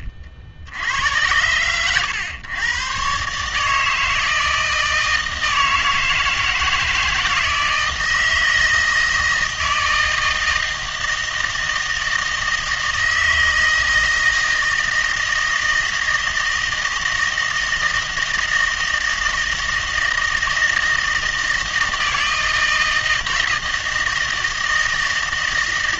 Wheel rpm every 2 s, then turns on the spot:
70, 110, 160, 160, 160, 160, 160, 160, 160, 160, 160, 160, 160.
none